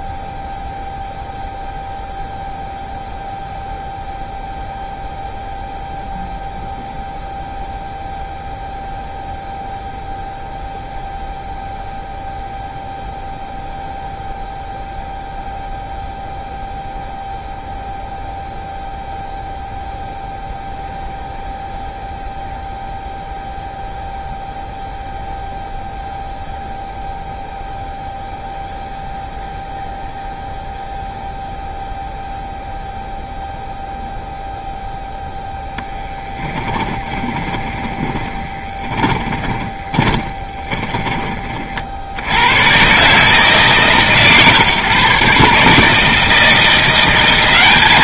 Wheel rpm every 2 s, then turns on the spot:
0, 0, 0, 0, 0, 0, 0, 0, 0, 0, 0, 0, 0, 0, 0, 0, 0, 0, 10, 20, 20, 110, 140, 170.
36-42